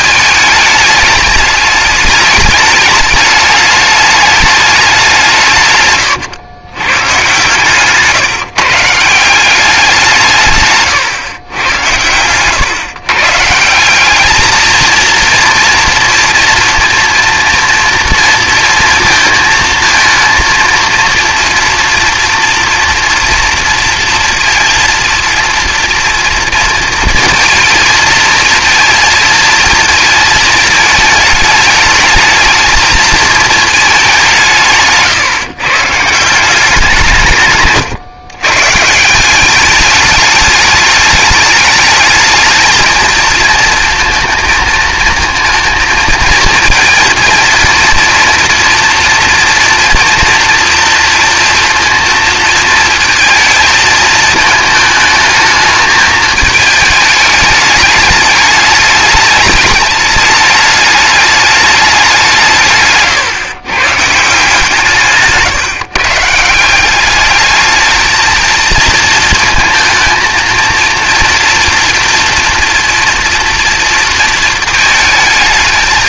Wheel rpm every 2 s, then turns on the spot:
210, 210, 190, 120, 150, 140, 140, 230, 230, 230, 230, 240, 230, 230, 230, 220, 220, 140, 160, 150, 210, 220, 220, 230, 230, 230, 230, 220, 210, 210, 210, 150, 160, 190, 220, 230, 230, 220.
62-64